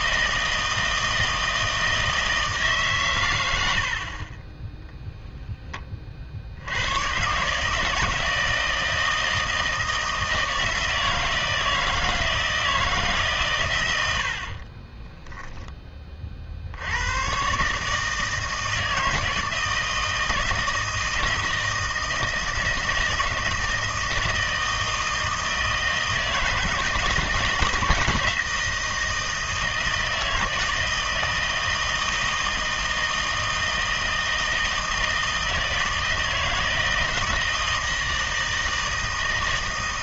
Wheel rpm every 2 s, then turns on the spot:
160, 140, 10, 90, 160, 160, 160, 20, 70, 160, 160, 160, 160, 160, 160, 160, 160, 160, 160, 160.
14-16